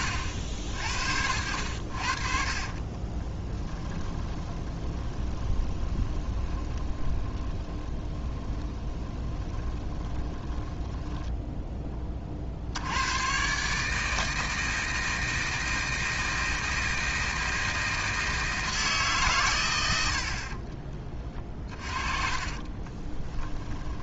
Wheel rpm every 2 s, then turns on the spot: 80, 40, 20, 30, 20, 10, 70, 160, 160, 160, 40, 30.
4-12 22-24